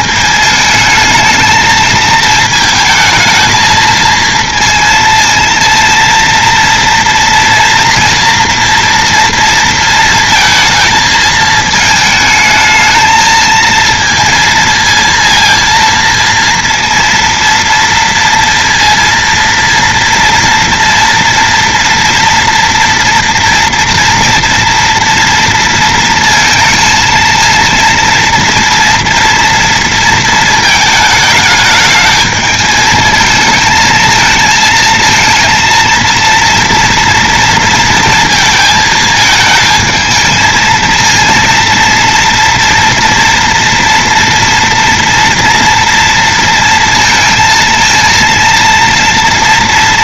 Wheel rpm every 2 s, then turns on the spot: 220, 220, 230, 230, 230, 220, 220, 230, 230, 230, 240, 240, 230, 230, 230, 220, 220, 230, 230, 220, 220, 230, 230, 230, 230.
none